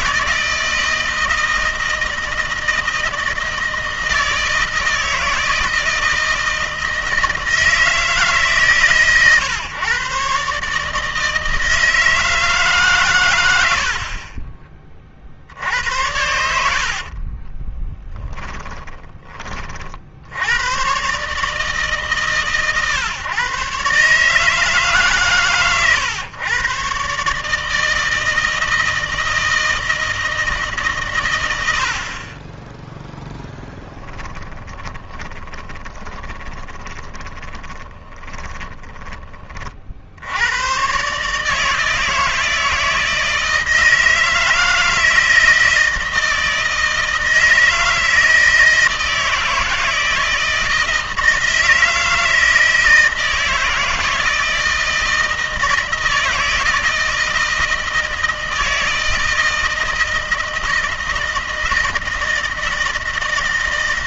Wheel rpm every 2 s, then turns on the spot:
160, 160, 160, 160, 150, 150, 150, 40, 70, 20, 120, 130, 150, 130, 160, 150, 10, 20, 20, 20, 110, 160, 160, 160, 160, 160, 160, 160, 160, 160, 160, 160.
16-20 34-40